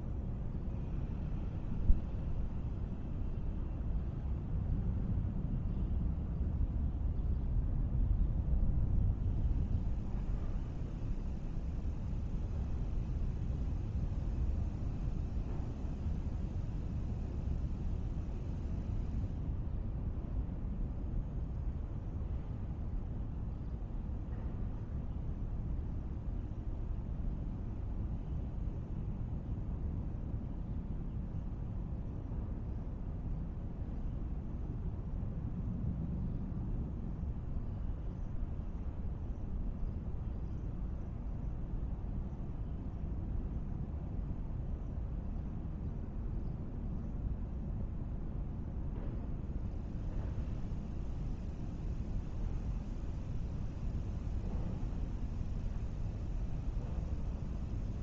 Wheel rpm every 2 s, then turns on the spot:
0, 0, 0, 0, 0, 0, 0, 0, 0, 0, 0, 0, 0, 0, 0, 0, 0, 0, 0, 0, 0, 0, 0, 0, 0, 0, 0, 0, 0.
none